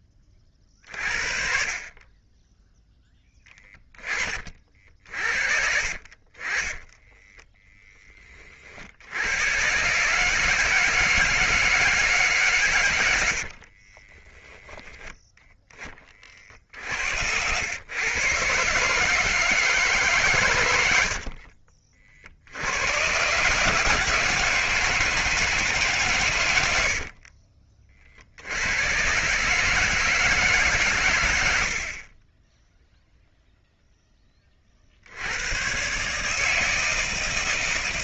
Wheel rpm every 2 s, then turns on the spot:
40, 10, 40, 20, 60, 160, 120, 10, 60, 140, 100, 90, 160, 80, 90, 130, 0, 50, 160.
26-28